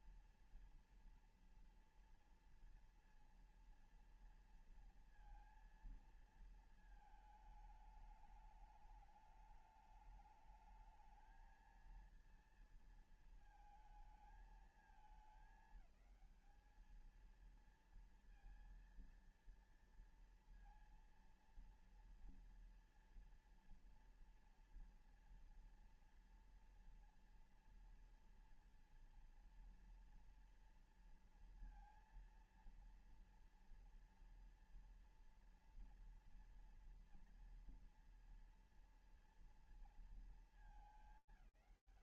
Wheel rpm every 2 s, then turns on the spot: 230, 230, 230, 230, 210, 210, 230, 220, 220, 230, 230, 230, 230, 230, 230, 240, 230, 230, 230, 230, 220.
none